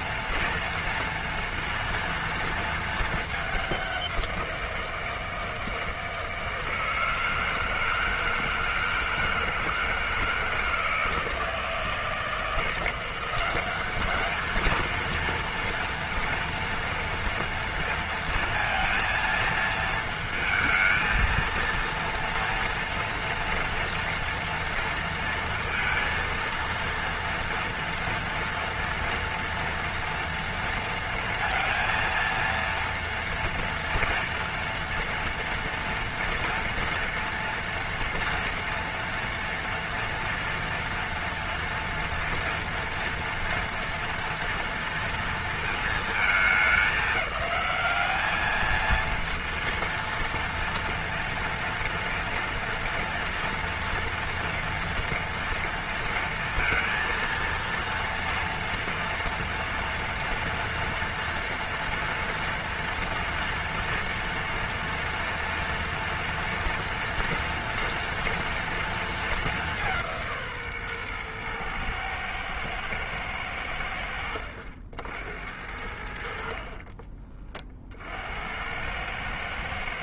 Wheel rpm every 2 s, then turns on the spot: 230, 220, 170, 160, 160, 160, 170, 220, 230, 230, 220, 230, 230, 230, 230, 230, 230, 230, 230, 230, 230, 230, 230, 210, 220, 230, 230, 230, 230, 230, 230, 230, 240, 230, 230, 140, 110, 70, 50, 80.
none